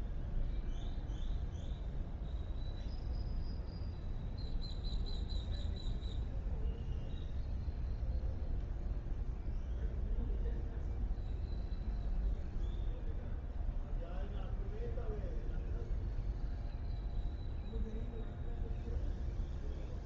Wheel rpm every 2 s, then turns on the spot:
0, 0, 0, 0, 0, 0, 0, 0, 0, 0.
none